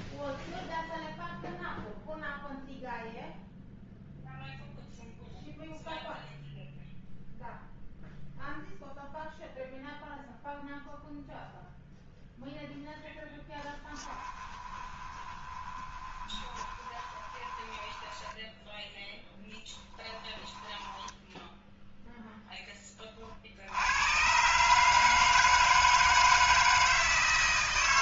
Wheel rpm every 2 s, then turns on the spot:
0, 0, 0, 0, 0, 0, 0, 20, 20, 10, 10, 10, 150, 160.
14-18 20-22